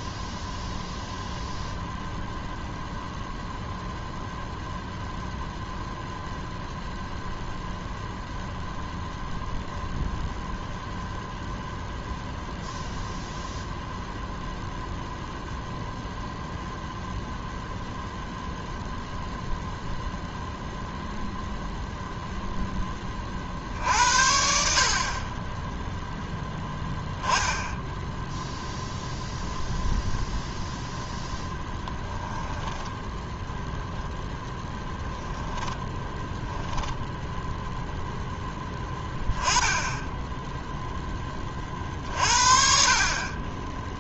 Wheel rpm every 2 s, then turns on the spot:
0, 0, 0, 0, 0, 0, 0, 0, 0, 0, 0, 10, 80, 10, 0, 0, 0, 20, 0, 10, 10, 50.
none